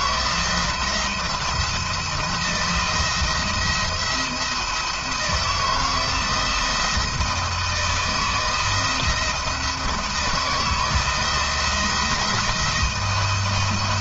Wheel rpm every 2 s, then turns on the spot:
170, 170, 170, 160, 170, 160, 170.
none